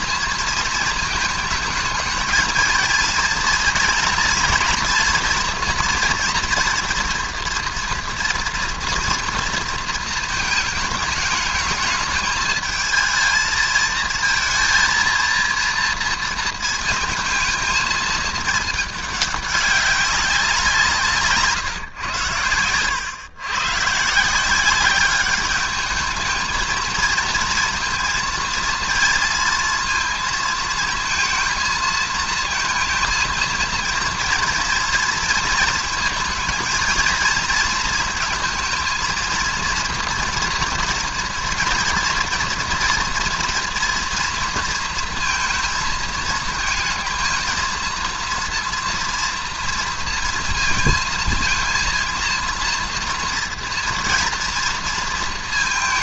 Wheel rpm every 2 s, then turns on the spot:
230, 230, 230, 240, 230, 220, 220, 230, 230, 210, 180, 110, 190, 220, 230, 220, 230, 240, 230, 230, 230, 230, 230, 220, 230, 230, 230, 230.
none